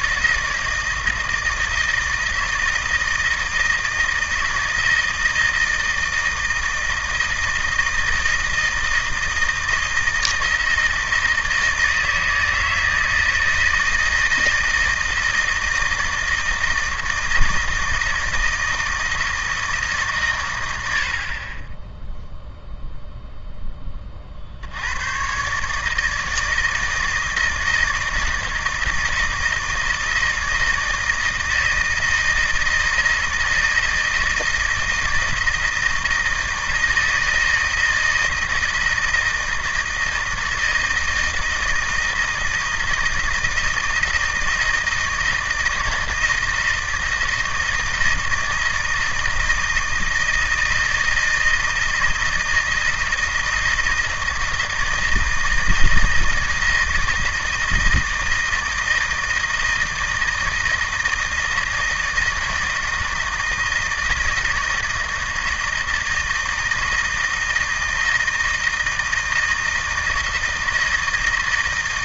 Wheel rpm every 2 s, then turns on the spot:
160, 160, 160, 160, 160, 160, 160, 160, 160, 160, 90, 0, 80, 160, 160, 160, 160, 160, 160, 160, 160, 160, 160, 160, 160, 160, 160, 160, 160, 160, 160, 160, 160, 160, 160, 160.
none